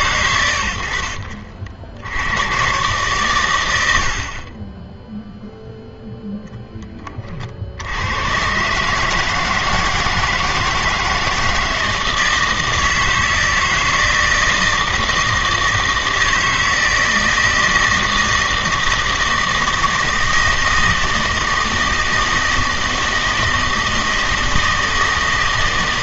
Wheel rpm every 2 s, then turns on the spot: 80, 130, 20, 10, 140, 160, 160, 160, 160, 160, 160, 160, 160.
none